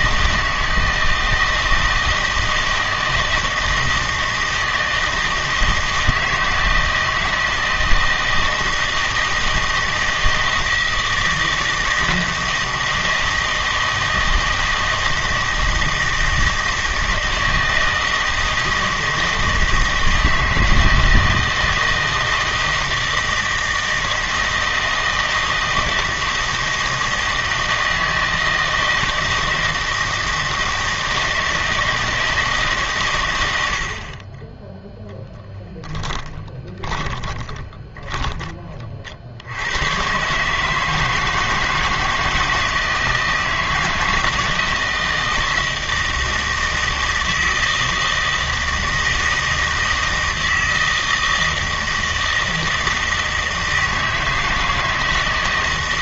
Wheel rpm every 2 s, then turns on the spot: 160, 160, 160, 160, 160, 160, 160, 160, 160, 160, 160, 160, 160, 160, 160, 160, 140, 10, 10, 30, 150, 160, 160, 160, 160, 160, 160, 160.
36-38